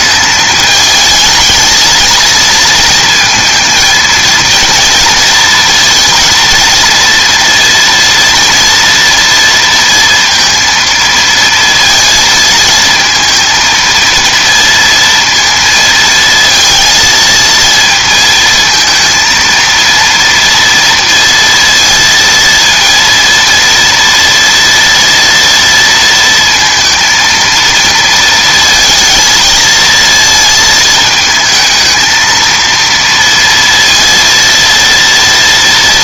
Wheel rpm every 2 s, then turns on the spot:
210, 230, 230, 230, 230, 230, 220, 230, 230, 230, 230, 230, 230, 230, 230, 220, 230, 230.
none